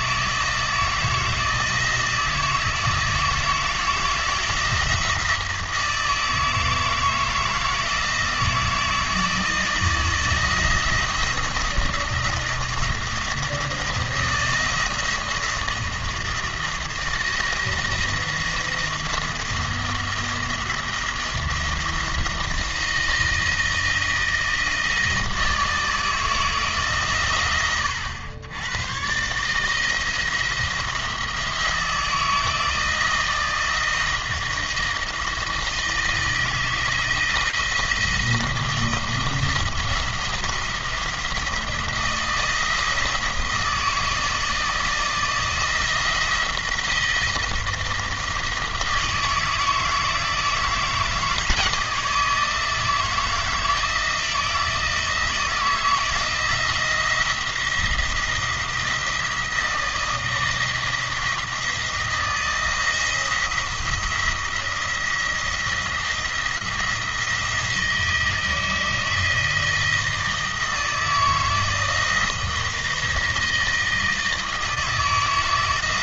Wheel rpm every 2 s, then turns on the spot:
160, 160, 170, 160, 160, 170, 170, 170, 170, 170, 170, 160, 160, 140, 120, 170, 160, 170, 160, 160, 170, 160, 160, 170, 160, 160, 160, 160, 170, 170, 160, 170, 170, 170, 160, 160, 160, 160.
none